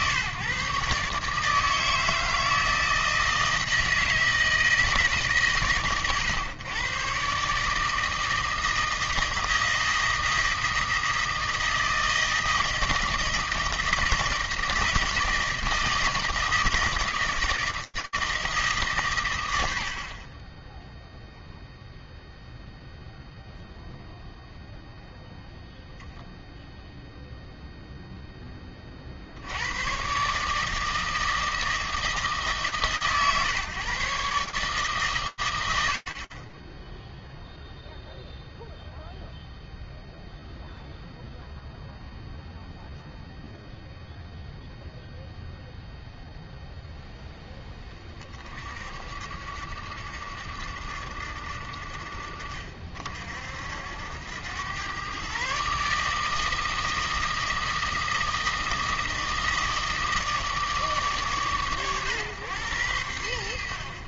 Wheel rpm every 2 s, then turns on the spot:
140, 160, 160, 120, 160, 160, 160, 170, 160, 140, 0, 0, 0, 0, 50, 160, 130, 120, 0, 0, 0, 0, 0, 10, 70, 50, 70, 140, 160, 160, 110, 70.
none